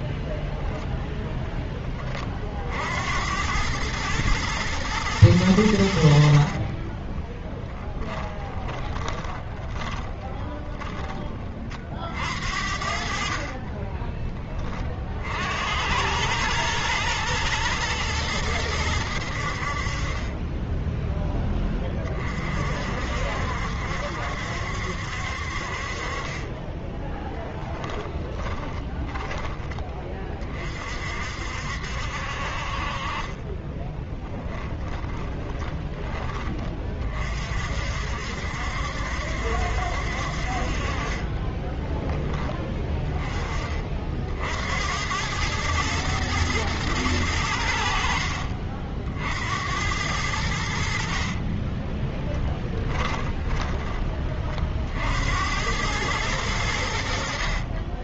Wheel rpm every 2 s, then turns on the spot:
10, 60, 110, 50, 20, 30, 70, 30, 110, 100, 10, 50, 70, 20, 20, 40, 40, 10, 30, 70, 50, 10, 70, 110, 60, 80, 20, 50, 90.
0-2 6-10 12-14 26-30 34-36 50-54